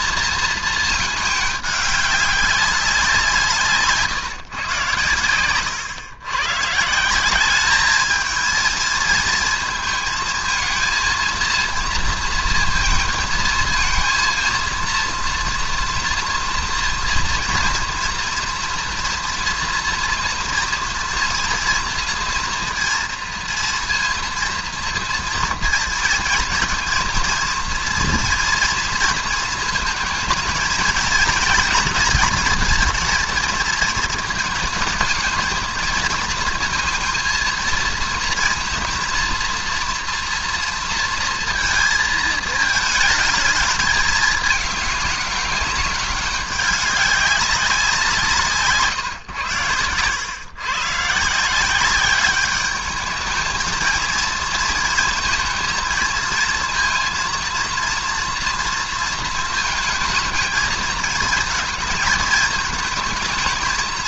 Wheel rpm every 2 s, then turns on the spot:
220, 200, 140, 140, 220, 220, 230, 230, 230, 230, 230, 230, 230, 230, 240, 230, 230, 220, 230, 230, 230, 220, 210, 200, 160, 120, 200, 220, 230, 230, 220, 220.
none